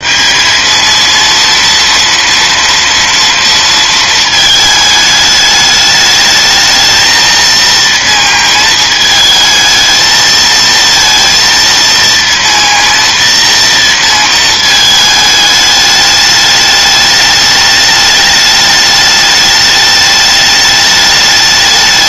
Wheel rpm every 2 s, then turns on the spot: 220, 230, 220, 220, 220, 230, 230, 220, 210, 210, 210.
none